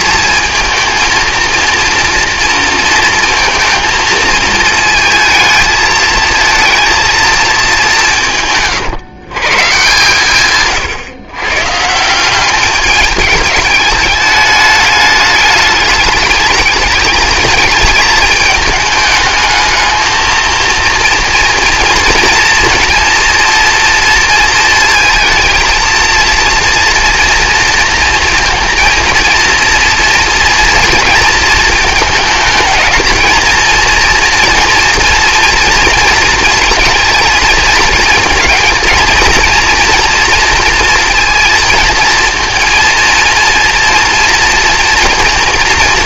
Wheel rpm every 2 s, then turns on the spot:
230, 230, 220, 230, 140, 130, 200, 210, 210, 210, 230, 230, 220, 230, 230, 230, 210, 230, 220, 220, 230, 230, 230.
10-12